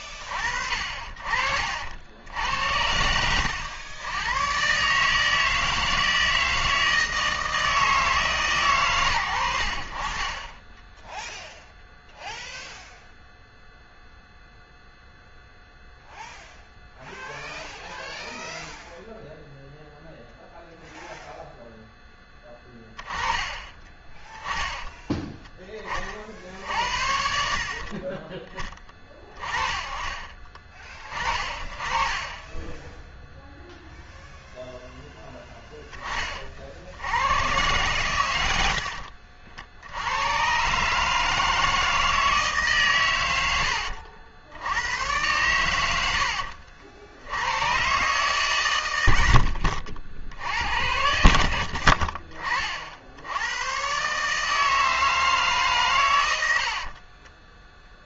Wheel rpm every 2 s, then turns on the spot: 50, 80, 140, 160, 110, 10, 0, 0, 0, 0, 0, 10, 20, 40, 30, 30, 10, 0, 60, 70, 140, 130, 90, 80, 90, 70, 60, 160, 40.
38-40 48-50 56-58